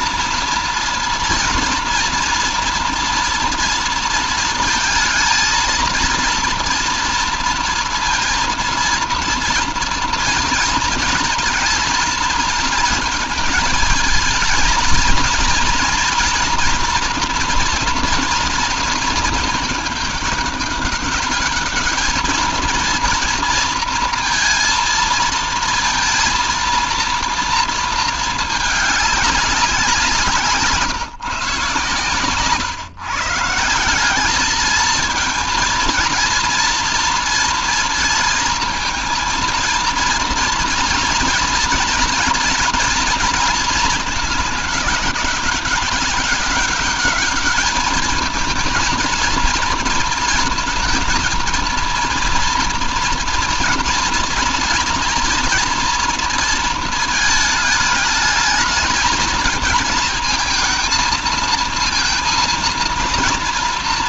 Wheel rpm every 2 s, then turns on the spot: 230, 230, 220, 230, 230, 220, 230, 230, 230, 230, 200, 230, 230, 230, 210, 150, 130, 220, 230, 230, 240, 230, 210, 200, 230, 230, 230, 230, 230, 220, 220, 230.
none